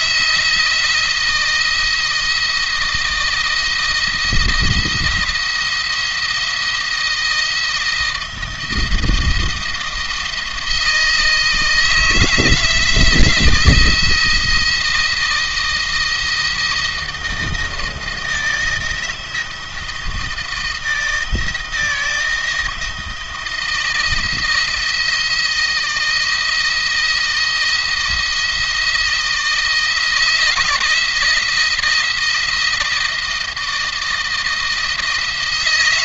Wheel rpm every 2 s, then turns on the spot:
170, 170, 170, 170, 170, 160, 170, 170, 170, 160, 160, 160, 170, 160, 160, 170, 170, 160.
none